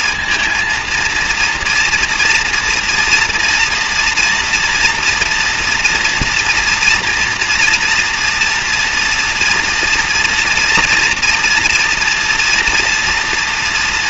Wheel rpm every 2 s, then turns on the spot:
230, 230, 230, 240, 240, 230, 230.
none